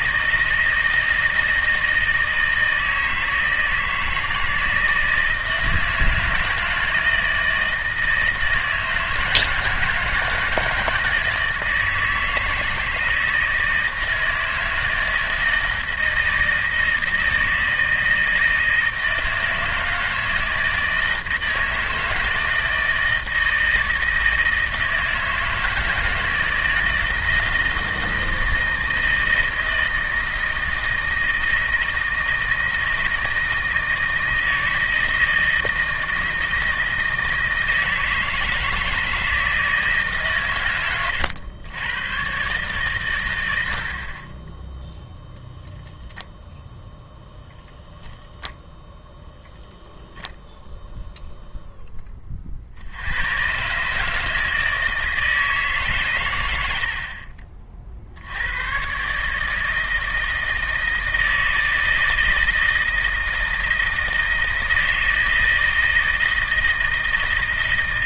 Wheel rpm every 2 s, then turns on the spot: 160, 160, 160, 160, 160, 160, 160, 160, 160, 160, 160, 160, 160, 160, 160, 160, 160, 160, 160, 160, 140, 130, 10, 0, 0, 0, 60, 160, 90, 110, 160, 160, 160, 160.
none